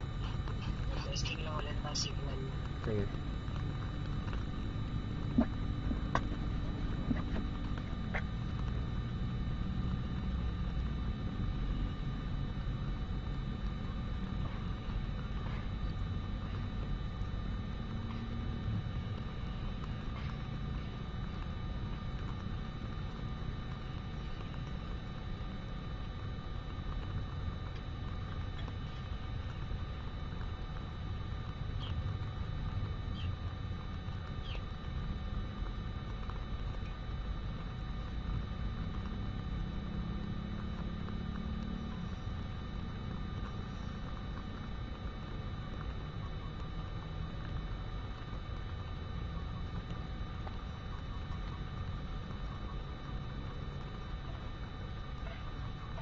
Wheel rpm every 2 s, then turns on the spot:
0, 0, 0, 0, 0, 0, 0, 0, 0, 0, 0, 0, 0, 0, 0, 0, 0, 0, 0, 0, 0, 0, 0, 0, 0, 0, 0, 0.
none